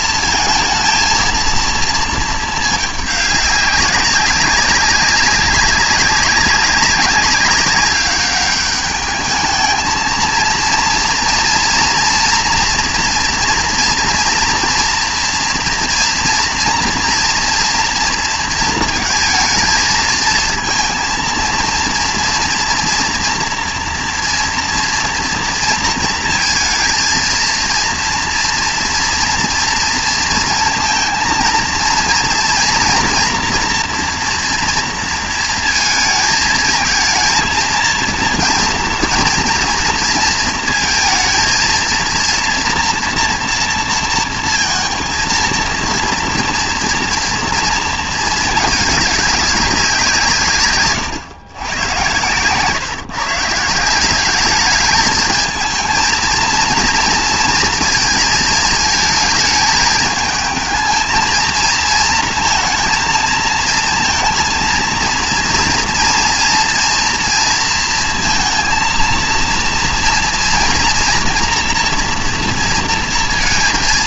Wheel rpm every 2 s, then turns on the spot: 230, 220, 190, 190, 200, 230, 230, 230, 230, 230, 230, 240, 230, 230, 230, 230, 230, 240, 220, 230, 230, 230, 230, 230, 210, 140, 140, 210, 230, 220, 220, 230, 230, 240, 230, 240, 230.
none